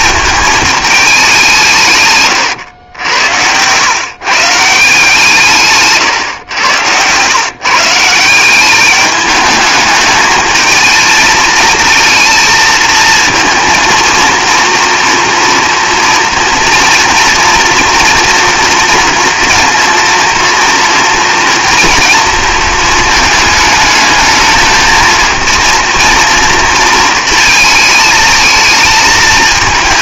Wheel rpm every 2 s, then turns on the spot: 220, 110, 160, 110, 190, 220, 220, 230, 230, 230, 230, 230, 220, 230, 220.
2-4 6-8